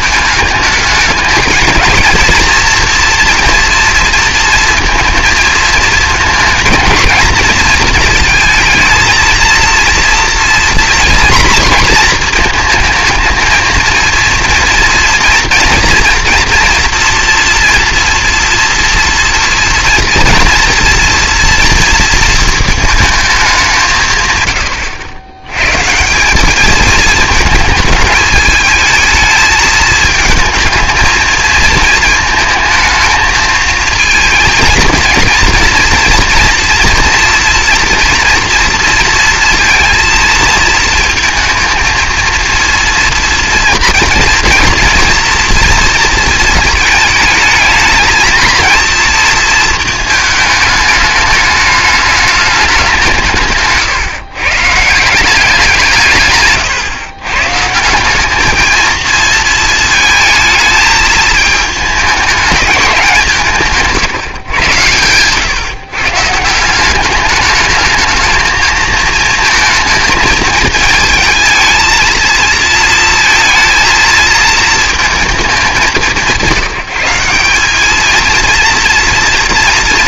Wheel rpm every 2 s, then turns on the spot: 210, 230, 230, 230, 230, 230, 230, 230, 230, 230, 230, 230, 130, 190, 220, 220, 220, 230, 240, 230, 220, 230, 230, 220, 220, 210, 210, 130, 140, 210, 220, 210, 130, 160, 220, 220, 220, 220, 180, 230.
none